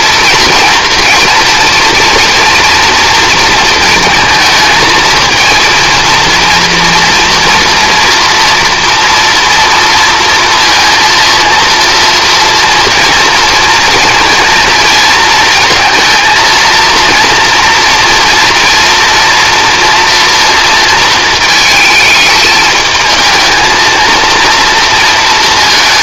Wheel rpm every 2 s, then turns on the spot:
230, 230, 230, 230, 230, 230, 230, 230, 230, 230, 230, 220, 230.
none